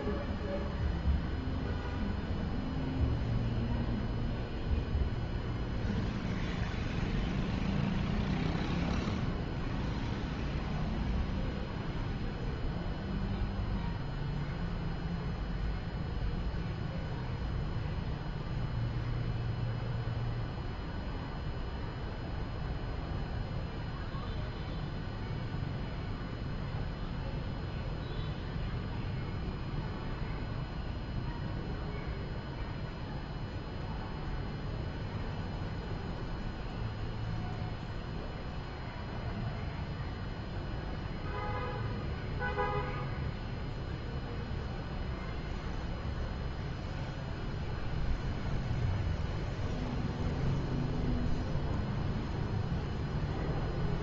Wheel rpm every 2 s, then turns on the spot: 0, 0, 0, 0, 0, 0, 0, 0, 0, 0, 0, 0, 0, 0, 0, 0, 0, 0, 0, 0, 0, 0, 0, 0, 0, 0, 0.
none